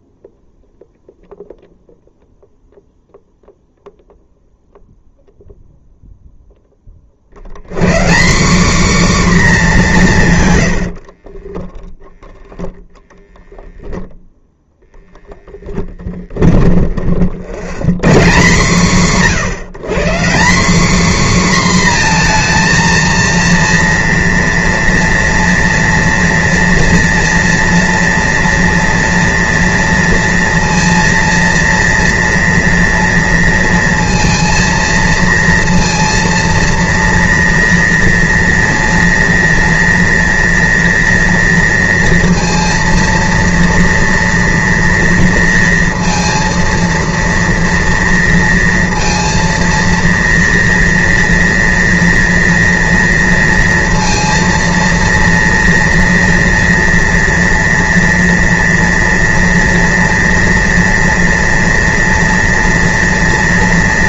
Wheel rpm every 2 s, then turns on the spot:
0, 0, 0, 20, 250, 110, 0, 0, 40, 160, 220, 240, 240, 230, 230, 230, 230, 230, 230, 230, 230, 230, 230, 230, 230, 230, 230, 230, 230, 230, 230, 230.
10-12 16-18